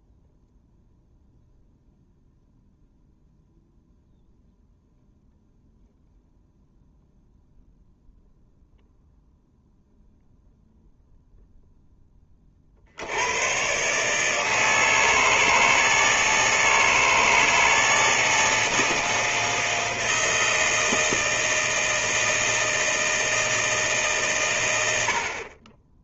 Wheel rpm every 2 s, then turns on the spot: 0, 0, 0, 0, 0, 0, 50, 160, 160, 160, 160, 160, 120.
none